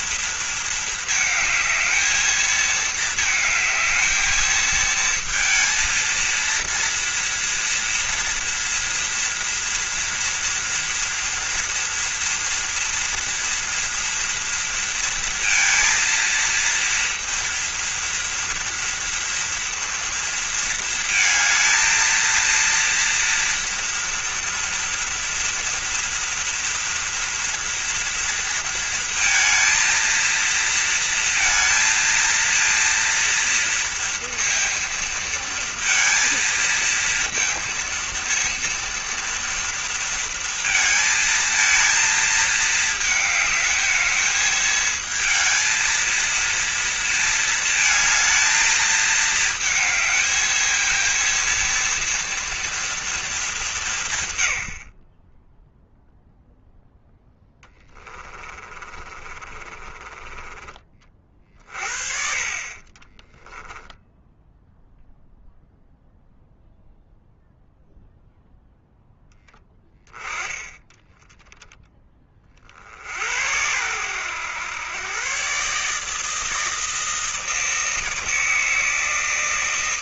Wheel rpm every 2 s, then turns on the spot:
220, 220, 220, 230, 230, 230, 230, 230, 230, 230, 230, 230, 230, 230, 230, 230, 230, 230, 230, 230, 230, 220, 220, 230, 220, 220, 240, 80, 0, 30, 30, 30, 0, 0, 0, 20, 50, 110, 160, 160.
58-60 62-64